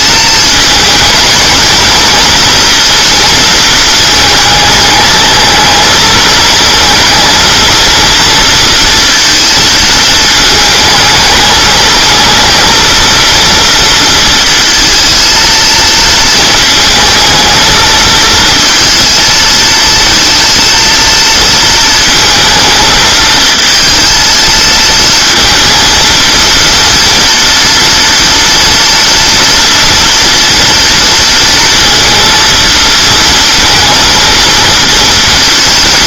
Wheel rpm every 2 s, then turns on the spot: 220, 230, 220, 230, 230, 220, 230, 230, 220, 230, 230, 220, 230, 230, 230, 230, 230, 230.
none